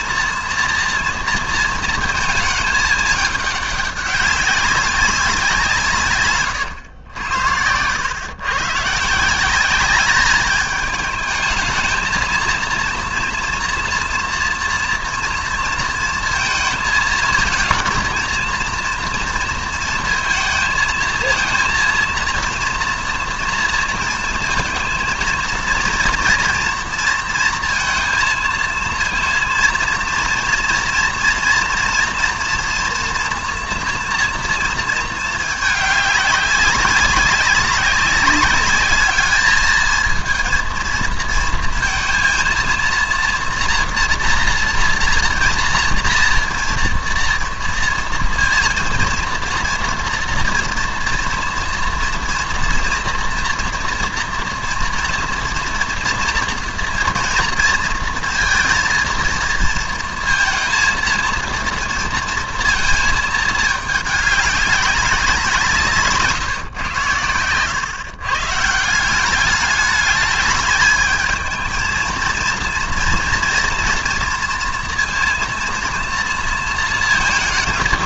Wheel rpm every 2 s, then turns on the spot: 230, 220, 190, 120, 130, 210, 230, 230, 220, 230, 220, 230, 230, 230, 230, 230, 230, 220, 190, 200, 230, 230, 240, 230, 230, 230, 230, 230, 230, 230, 230, 230, 200, 120, 160, 210, 230, 230, 230.
none